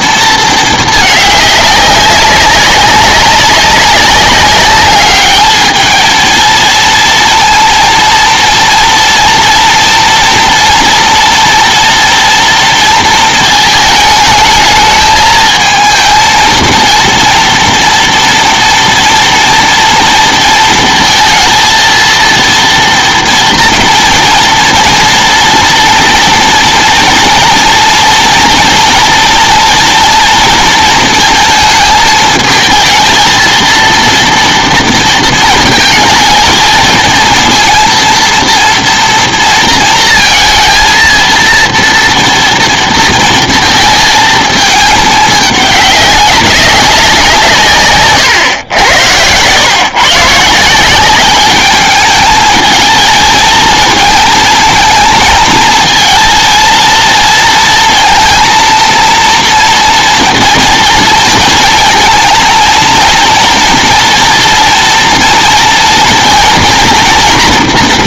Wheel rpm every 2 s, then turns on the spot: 220, 190, 200, 230, 230, 230, 230, 220, 230, 230, 230, 230, 230, 240, 230, 230, 220, 230, 220, 240, 230, 230, 220, 190, 110, 170, 220, 220, 230, 230, 230, 230, 240, 230.
48-50